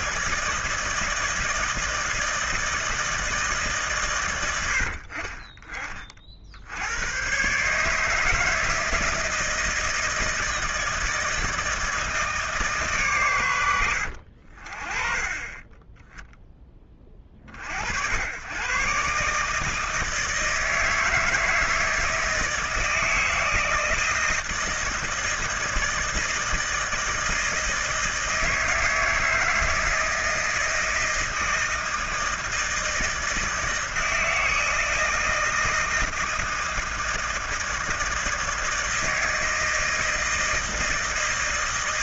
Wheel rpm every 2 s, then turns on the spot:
160, 160, 110, 70, 160, 160, 150, 50, 10, 110, 160, 160, 160, 160, 160, 160, 160, 160, 160, 160, 160.
none